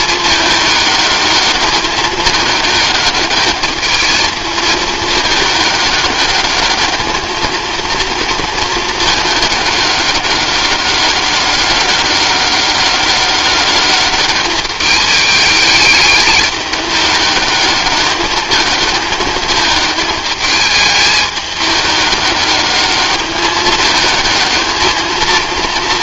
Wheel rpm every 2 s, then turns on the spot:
210, 210, 220, 210, 220, 200, 200, 210, 210, 220, 210, 200, 220.
none